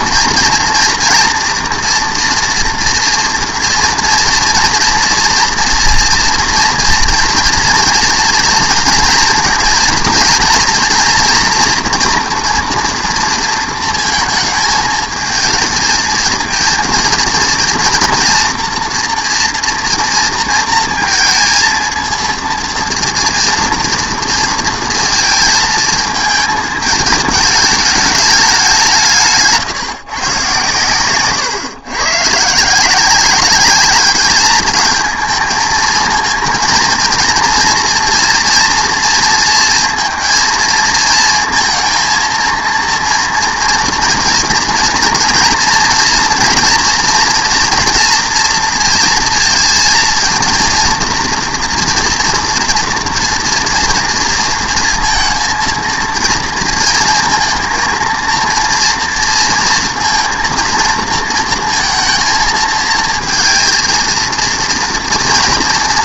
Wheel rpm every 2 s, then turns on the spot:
240, 230, 230, 230, 230, 230, 230, 220, 230, 230, 230, 230, 230, 210, 190, 130, 160, 220, 230, 230, 230, 230, 230, 240, 230, 230, 240, 230, 230, 230, 230, 220, 230.
none